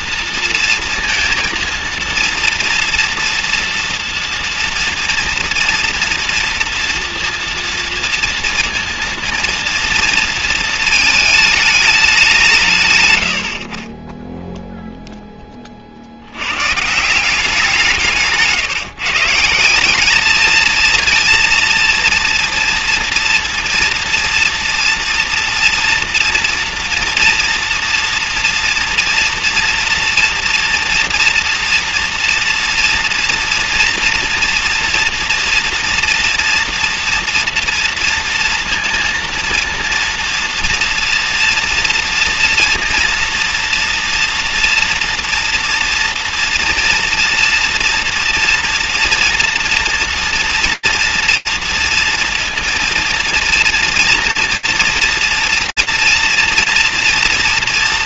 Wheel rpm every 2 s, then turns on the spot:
230, 230, 230, 230, 230, 230, 150, 0, 110, 160, 220, 230, 230, 230, 230, 230, 230, 230, 240, 230, 230, 230, 230, 230, 230, 230, 230, 230, 230.
none